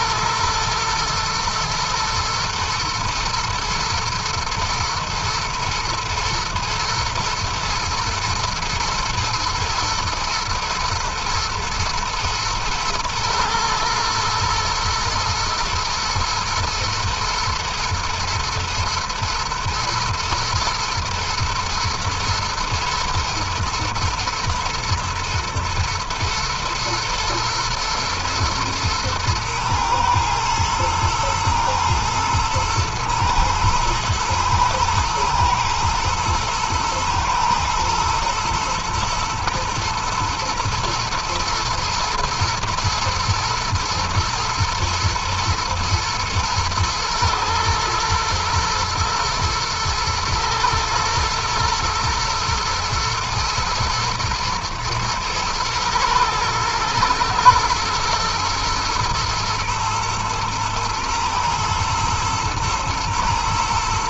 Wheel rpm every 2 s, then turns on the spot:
120, 120, 110, 120, 110, 120, 110, 110, 110, 120, 110, 120, 120, 120, 110, 110, 110, 110, 110, 110, 110, 110, 110, 110, 110, 110, 110, 120, 120, 120, 110, 120.
none